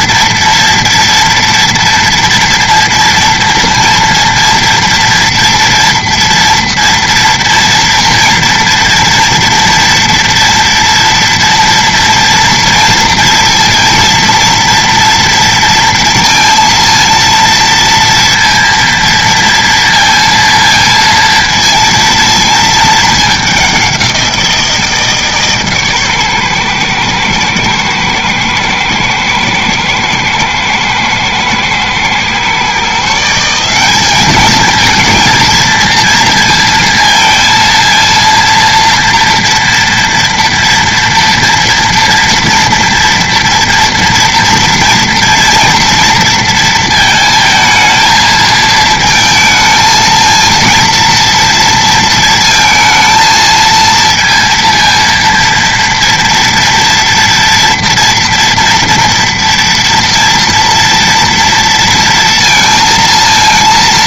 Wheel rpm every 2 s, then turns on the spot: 230, 230, 230, 230, 240, 230, 230, 240, 230, 230, 230, 220, 170, 120, 110, 110, 140, 220, 230, 230, 230, 230, 230, 220, 220, 230, 230, 230, 230, 230, 230, 230.
none